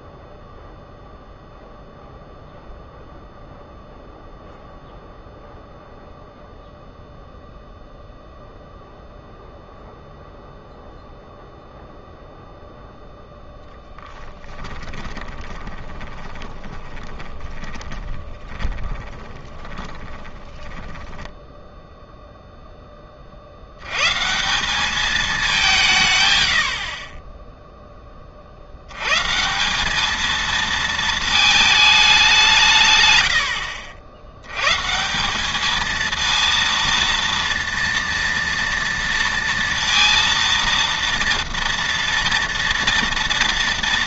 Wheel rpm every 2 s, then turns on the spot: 0, 0, 0, 0, 0, 0, 0, 20, 20, 20, 10, 10, 190, 70, 80, 230, 150, 140, 230, 230, 230, 230.
14-22